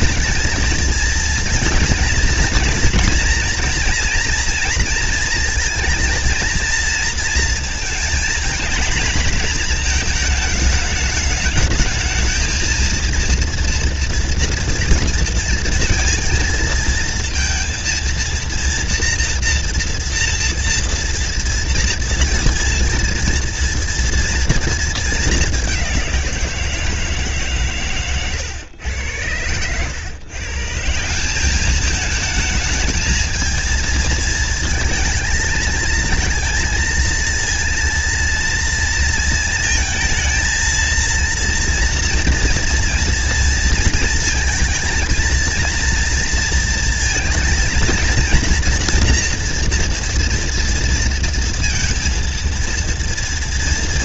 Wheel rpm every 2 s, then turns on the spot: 230, 230, 230, 230, 220, 210, 230, 230, 230, 230, 230, 230, 220, 160, 100, 180, 220, 230, 230, 230, 230, 230, 230, 230, 240, 230, 230.
none